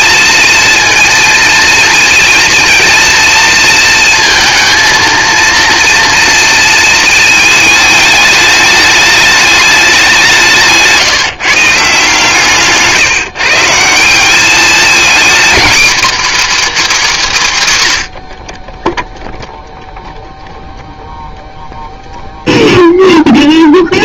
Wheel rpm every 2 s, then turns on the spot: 230, 230, 230, 230, 210, 150, 150, 220, 280, 20, 0, 0.
none